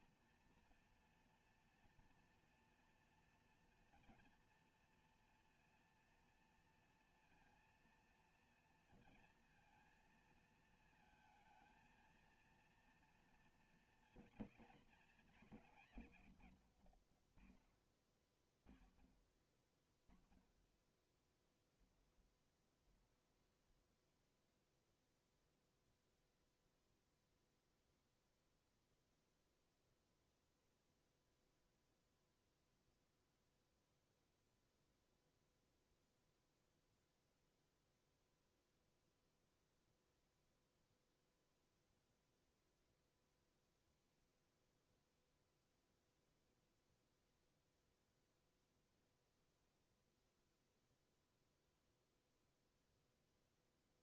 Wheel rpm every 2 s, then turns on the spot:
230, 240, 240, 230, 230, 230, 230, 230, 50, 40, 10, 10, 0, 0, 0, 0, 0, 0, 0, 0, 0, 0, 0, 0, 0, 0, 0.
none